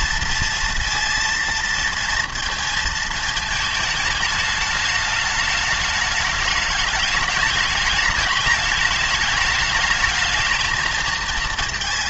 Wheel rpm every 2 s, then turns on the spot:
230, 230, 210, 210, 210, 220.
none